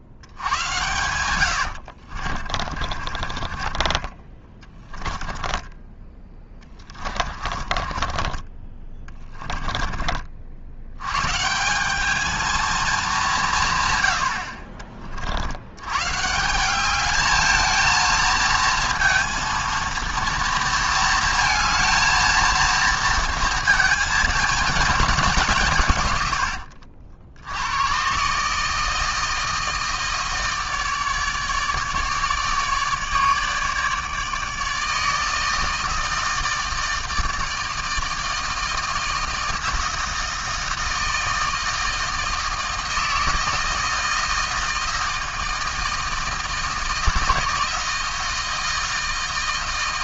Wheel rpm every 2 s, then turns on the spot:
100, 40, 20, 20, 30, 70, 220, 60, 190, 230, 230, 230, 220, 70, 160, 160, 150, 160, 160, 160, 160, 160, 160, 160, 160.
0-8 26-28